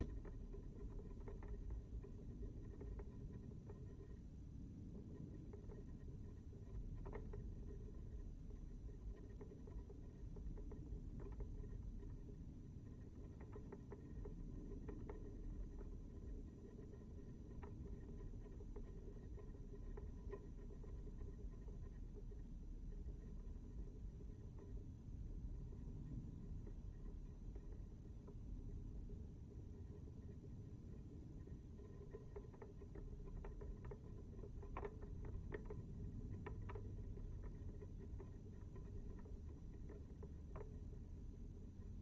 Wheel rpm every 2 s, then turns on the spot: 0, 0, 0, 0, 0, 0, 0, 0, 0, 0, 0, 0, 0, 0, 0, 0, 0, 0, 0, 0, 0.
none